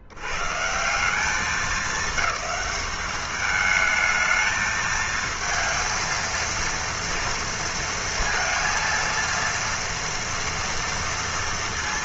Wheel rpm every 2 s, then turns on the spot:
80, 210, 220, 230, 230, 230.
none